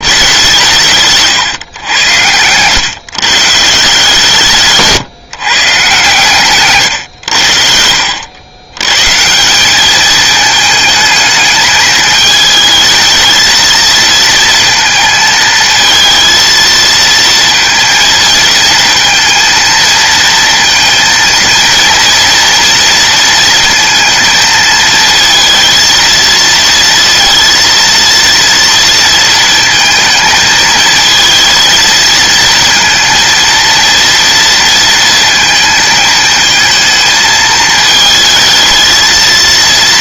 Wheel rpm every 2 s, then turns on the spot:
180, 120, 150, 130, 110, 220, 220, 230, 230, 230, 230, 230, 230, 230, 230, 220, 230, 230, 220, 220.
none